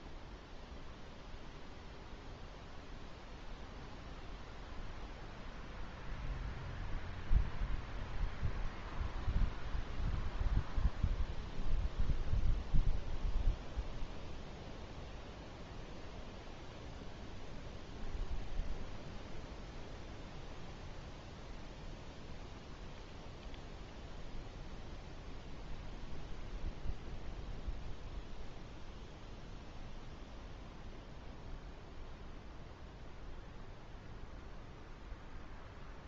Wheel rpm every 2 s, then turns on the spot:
0, 0, 0, 0, 0, 0, 0, 0, 0, 0, 0, 0, 0, 0, 0, 0, 0, 0.
none